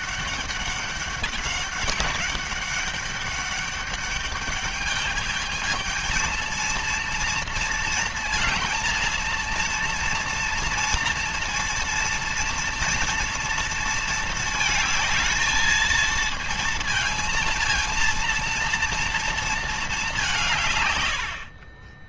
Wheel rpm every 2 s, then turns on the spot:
200, 200, 210, 230, 230, 230, 230, 220, 230, 230, 120.
none